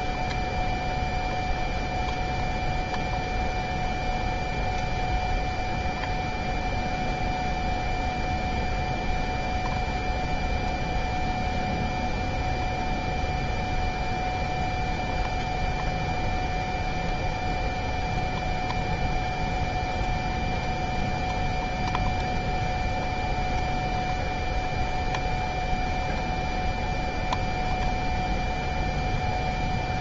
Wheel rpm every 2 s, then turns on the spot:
0, 0, 0, 0, 0, 0, 0, 0, 0, 0, 0, 0, 0, 0, 0.
none